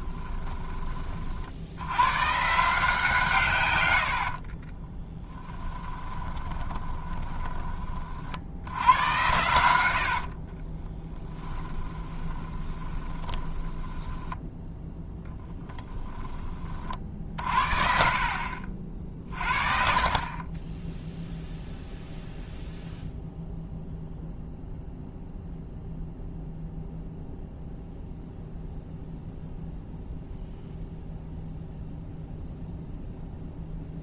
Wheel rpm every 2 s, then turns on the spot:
20, 160, 40, 20, 90, 30, 20, 10, 40, 60, 10, 0, 0, 0, 0, 0, 0.
4-8 10-14